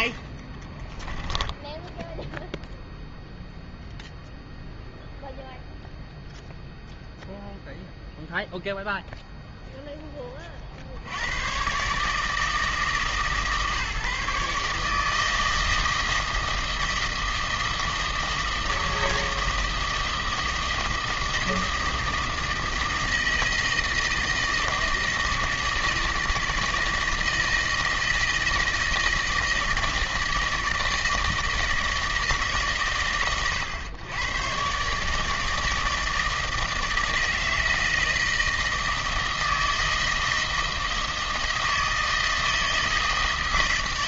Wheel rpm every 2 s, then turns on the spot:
20, 0, 0, 0, 0, 40, 160, 150, 160, 160, 160, 160, 160, 160, 160, 160, 130, 130, 160, 160, 160, 160.
0-2